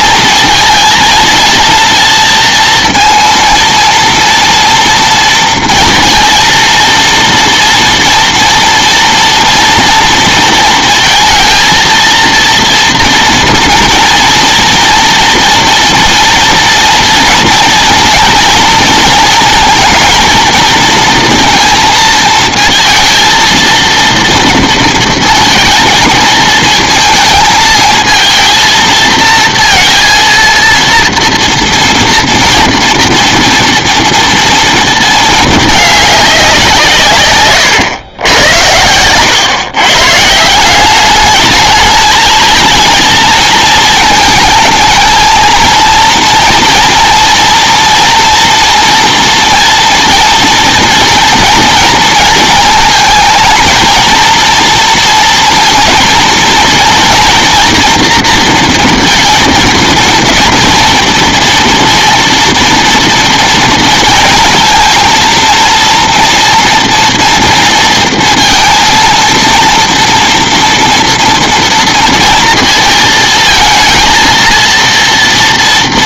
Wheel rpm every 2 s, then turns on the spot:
230, 230, 230, 230, 230, 230, 230, 240, 230, 230, 230, 220, 230, 220, 230, 230, 230, 230, 170, 100, 170, 220, 230, 230, 240, 230, 220, 230, 230, 230, 230, 230, 230, 230, 230, 230, 230, 230.
38-40